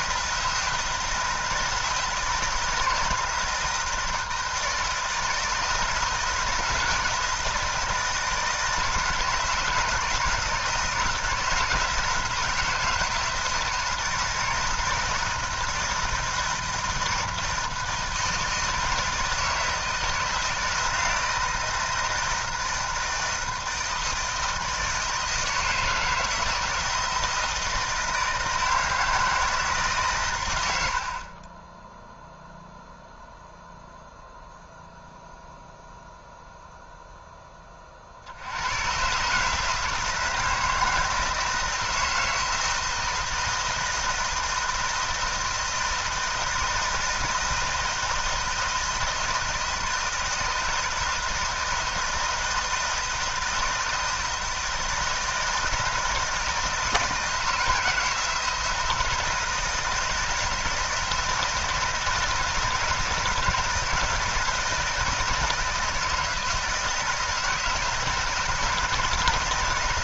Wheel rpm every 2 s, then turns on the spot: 160, 160, 160, 160, 160, 170, 160, 160, 160, 160, 160, 160, 160, 160, 160, 60, 0, 0, 0, 120, 160, 160, 160, 160, 160, 160, 160, 160, 160, 170, 160, 160, 160, 170, 160.
none